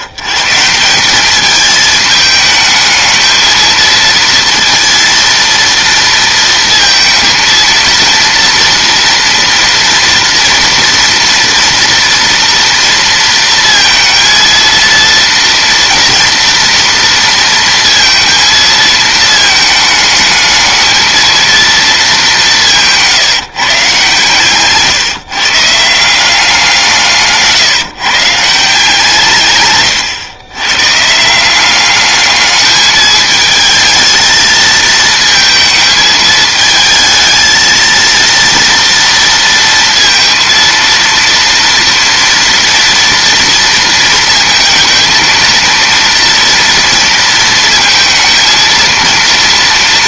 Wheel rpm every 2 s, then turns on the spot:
150, 210, 230, 230, 230, 230, 230, 230, 230, 220, 220, 180, 140, 180, 160, 130, 210, 220, 220, 230, 230, 230, 220, 230, 230.
none